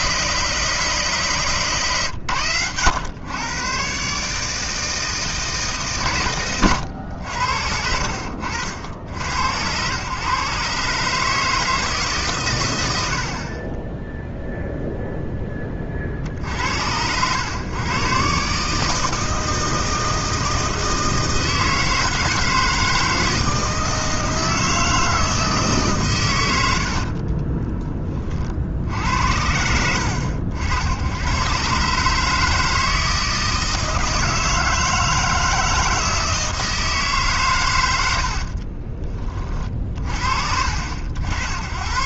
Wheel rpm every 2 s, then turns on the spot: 160, 100, 160, 110, 70, 140, 100, 0, 70, 150, 160, 160, 160, 80, 60, 80, 160, 160, 160, 40, 60.
38-40